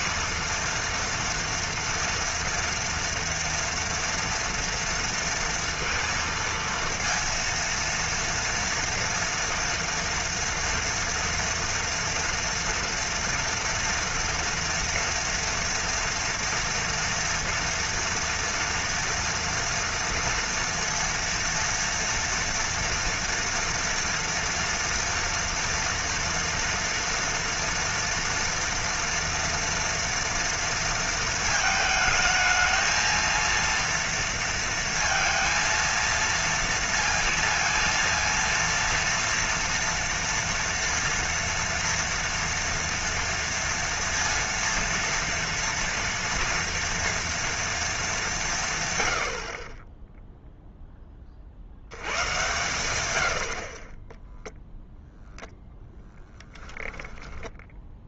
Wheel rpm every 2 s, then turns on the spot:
230, 230, 230, 230, 230, 230, 230, 230, 230, 230, 230, 230, 230, 230, 230, 230, 220, 230, 230, 230, 230, 240, 230, 230, 140, 0, 110, 0, 10.
56-58